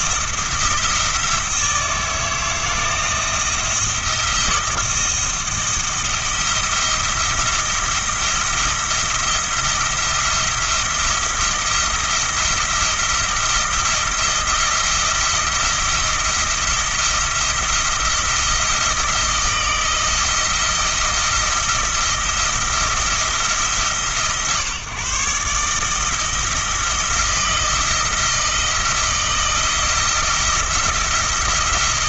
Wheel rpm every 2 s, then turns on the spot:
170, 170, 170, 170, 170, 170, 170, 170, 170, 170, 170, 170, 140, 160, 170, 170.
none